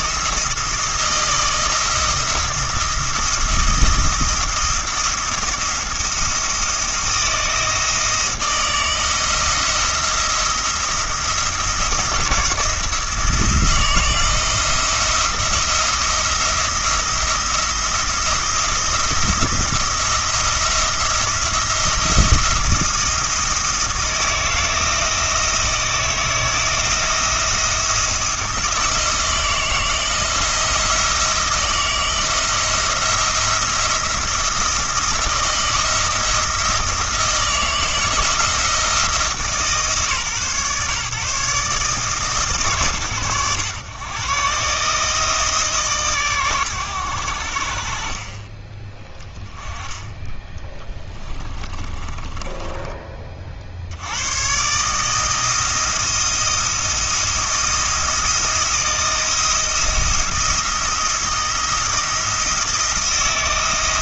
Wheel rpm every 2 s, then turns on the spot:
160, 170, 170, 170, 160, 170, 170, 170, 170, 170, 170, 170, 160, 160, 160, 170, 170, 170, 170, 170, 130, 110, 140, 120, 20, 20, 20, 140, 170, 160, 170, 160.
50-54